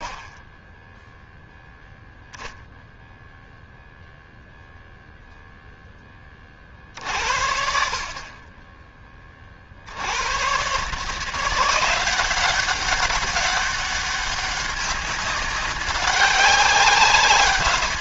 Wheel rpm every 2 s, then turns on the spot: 10, 0, 0, 50, 30, 130, 190, 200, 190.
none